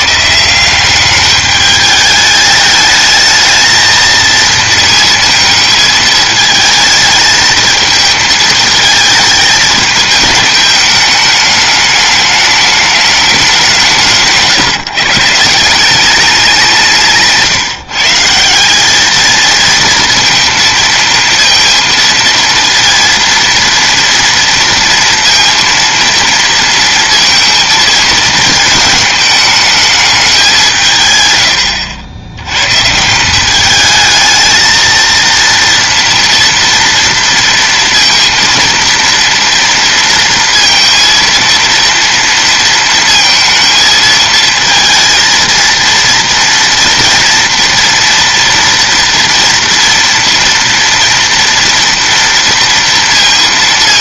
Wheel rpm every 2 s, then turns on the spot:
180, 210, 230, 220, 220, 210, 210, 160, 180, 180, 230, 230, 230, 230, 220, 180, 120, 220, 230, 230, 230, 230, 230, 230, 230, 230, 230.
none